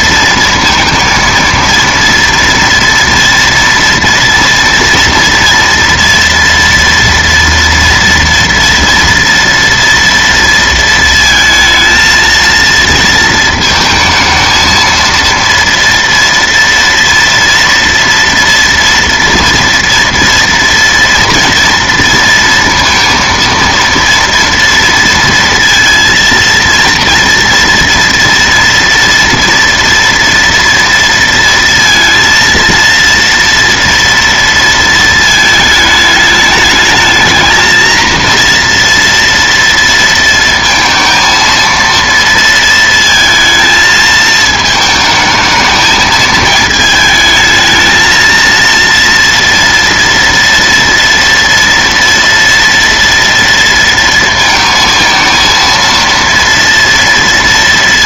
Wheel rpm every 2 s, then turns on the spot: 230, 230, 230, 230, 230, 230, 230, 220, 230, 230, 230, 230, 230, 230, 230, 230, 230, 230, 210, 230, 230, 230, 220, 220, 230, 230, 230, 230, 230.
none